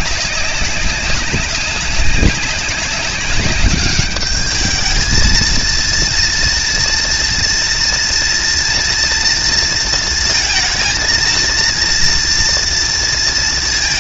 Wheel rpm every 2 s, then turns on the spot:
190, 190, 220, 230, 230, 230, 230.
none